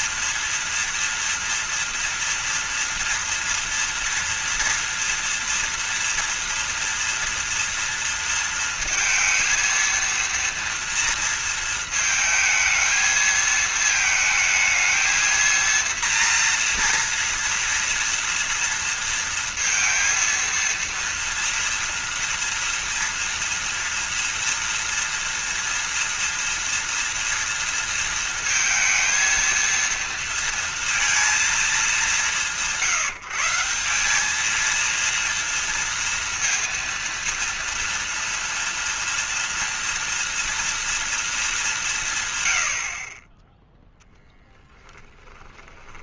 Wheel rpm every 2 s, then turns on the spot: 230, 230, 230, 230, 230, 230, 220, 220, 230, 230, 230, 230, 240, 240, 230, 230, 150, 230, 230, 230, 230, 70, 10.
44-46